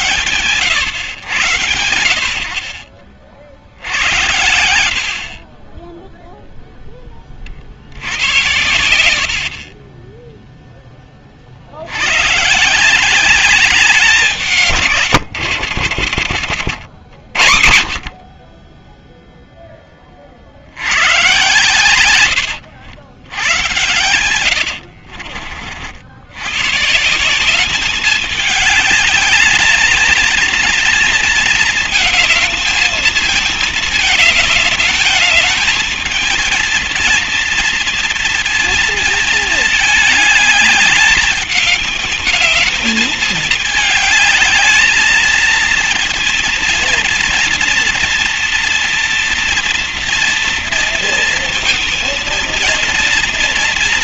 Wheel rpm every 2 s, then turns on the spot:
110, 60, 50, 50, 50, 60, 190, 110, 50, 0, 110, 100, 50, 180, 220, 220, 220, 220, 230, 220, 210, 210, 230, 230, 230, 230, 230.
14-16 22-24